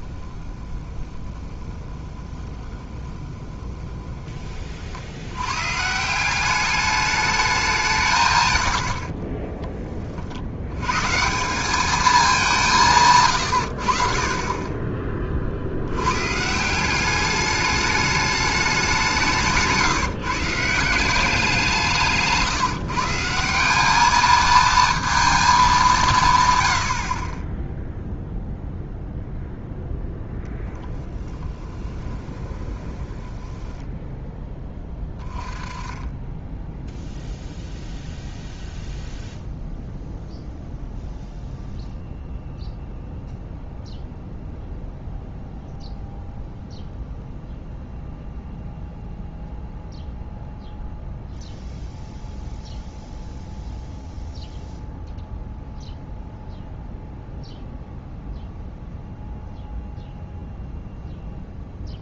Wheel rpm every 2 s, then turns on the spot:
20, 20, 50, 200, 80, 100, 180, 20, 170, 200, 170, 160, 220, 90, 0, 10, 20, 10, 10, 0, 0, 0, 0, 0, 0, 0, 0, 0, 0, 0, 0.
0-4 32-34